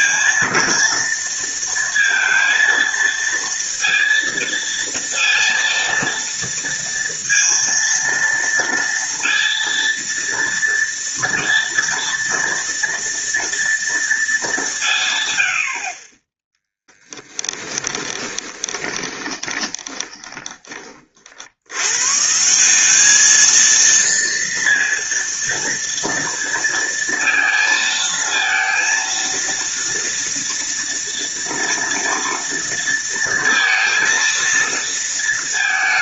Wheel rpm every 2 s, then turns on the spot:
230, 230, 230, 230, 230, 230, 230, 180, 10, 20, 30, 190, 230, 230, 230, 240, 230, 230.
18-20